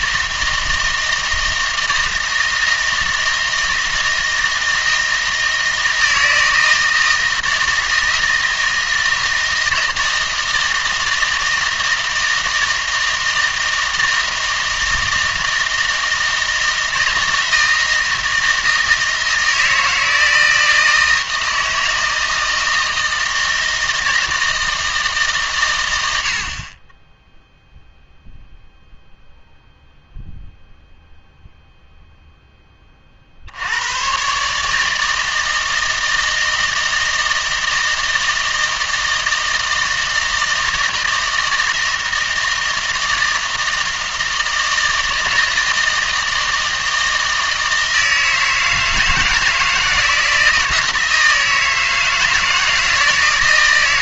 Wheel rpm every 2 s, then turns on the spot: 160, 160, 160, 160, 160, 160, 160, 160, 160, 160, 160, 160, 160, 30, 0, 0, 20, 140, 160, 160, 160, 160, 160, 160, 160, 160, 160.
none